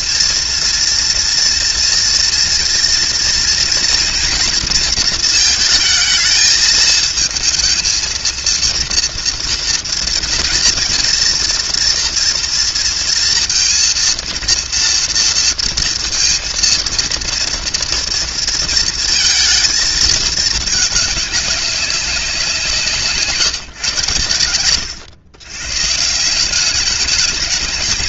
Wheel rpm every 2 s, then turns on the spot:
230, 230, 230, 220, 230, 230, 230, 230, 230, 230, 210, 180, 100, 190.
none